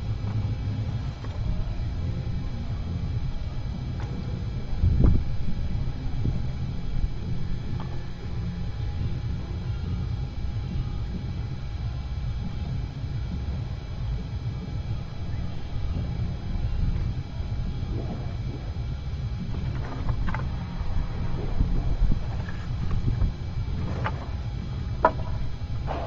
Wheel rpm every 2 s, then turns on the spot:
0, 0, 0, 0, 0, 0, 0, 0, 0, 0, 0, 0, 0.
none